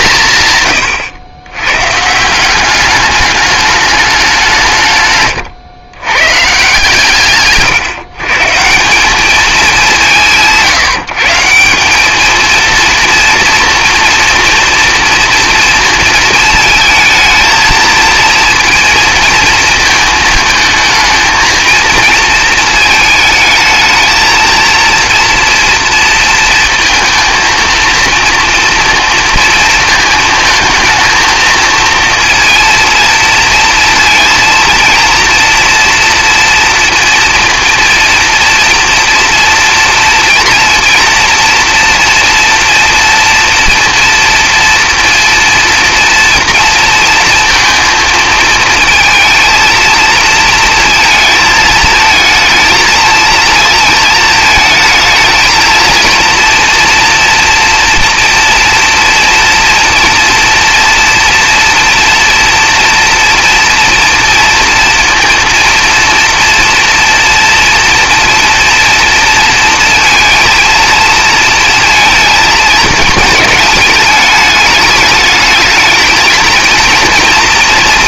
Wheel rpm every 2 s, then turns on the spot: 130, 190, 170, 140, 160, 170, 230, 230, 220, 230, 220, 220, 230, 220, 230, 220, 230, 230, 230, 230, 230, 230, 230, 230, 230, 230, 220, 220, 230, 230, 230, 230, 230, 230, 230, 230, 220, 210, 230.
none